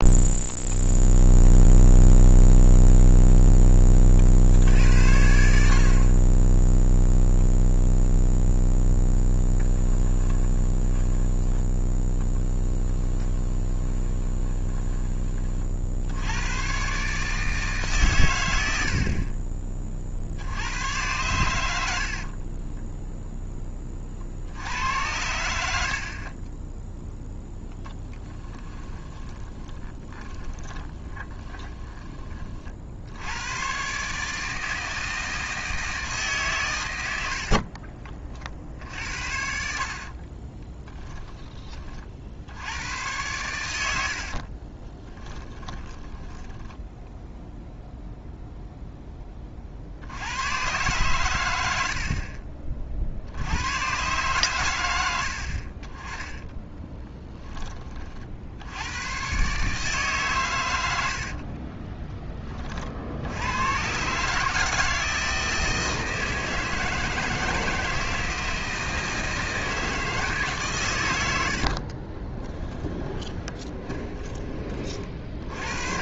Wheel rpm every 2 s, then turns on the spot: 0, 0, 70, 0, 0, 10, 20, 20, 140, 70, 90, 10, 90, 10, 20, 20, 60, 160, 100, 60, 10, 100, 20, 0, 10, 110, 40, 110, 20, 100, 90, 50, 160, 160, 160, 130, 20, 50.
12-14 22-24 28-32 40-42 44-46 60-62 72-74